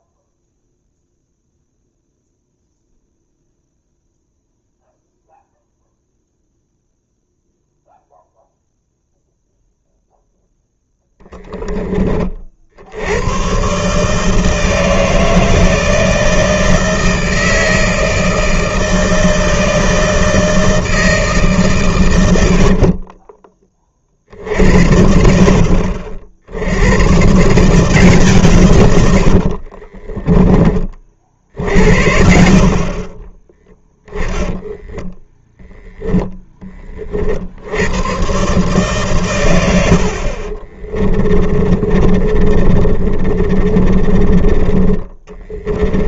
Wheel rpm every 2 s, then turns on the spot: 0, 0, 0, 0, 0, 0, 60, 160, 160, 160, 160, 70, 60, 80, 140, 40, 60, 10, 20, 130, 30, 30, 20.
22-24 34-36 40-46